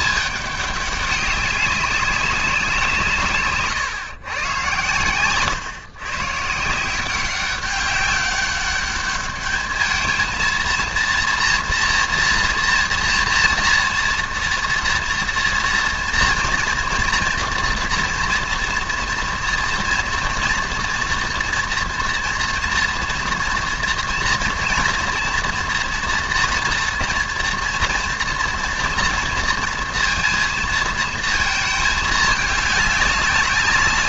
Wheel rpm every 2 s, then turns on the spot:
210, 190, 110, 150, 200, 230, 230, 230, 230, 240, 230, 230, 230, 240, 230, 230, 210.
none